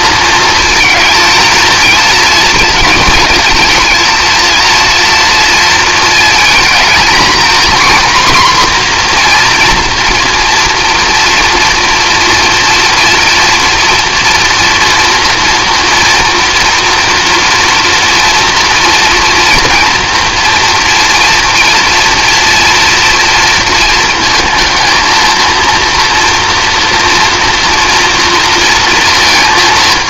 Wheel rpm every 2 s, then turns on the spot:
220, 220, 230, 230, 250, 230, 240, 240, 230, 240, 230, 230, 230, 230, 230.
none